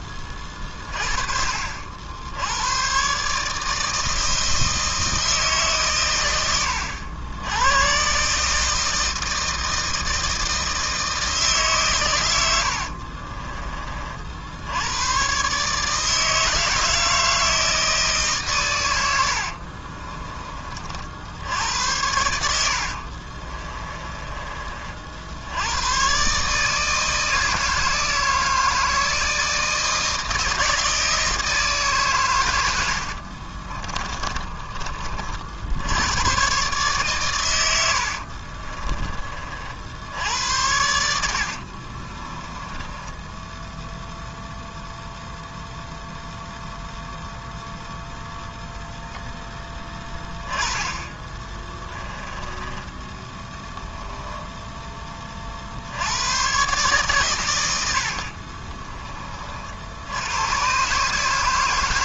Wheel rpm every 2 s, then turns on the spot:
30, 110, 160, 90, 160, 160, 60, 100, 160, 90, 50, 60, 50, 160, 160, 160, 70, 40, 130, 30, 80, 10, 0, 0, 10, 10, 10, 20, 130, 20, 140.
12-14 22-24 32-34 42-44 52-54